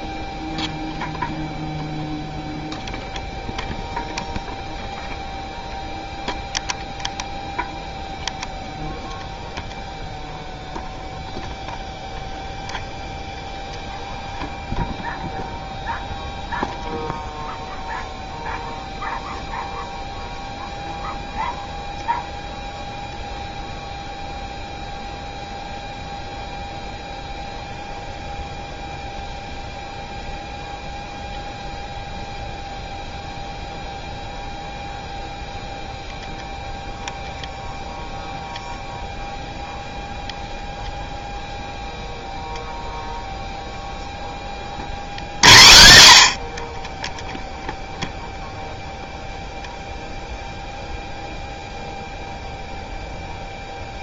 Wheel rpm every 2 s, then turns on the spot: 0, 0, 0, 0, 0, 0, 0, 0, 0, 0, 0, 0, 0, 0, 0, 0, 0, 0, 0, 0, 0, 0, 0, 0, 0, 0, 0.
none